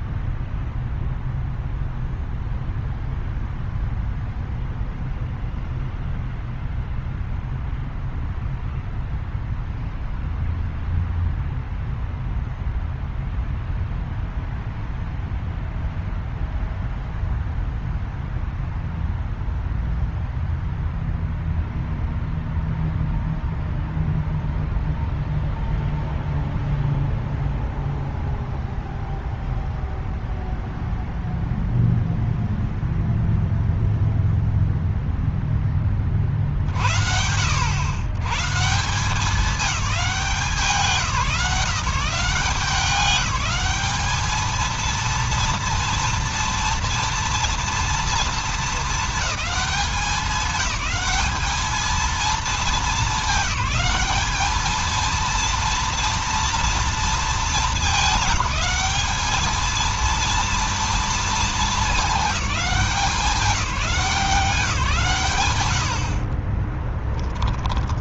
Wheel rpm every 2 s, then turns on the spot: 0, 0, 0, 0, 0, 0, 0, 0, 0, 0, 0, 0, 0, 0, 0, 0, 0, 0, 50, 170, 190, 190, 220, 230, 220, 210, 220, 220, 230, 210, 230, 200, 160, 20.
66-68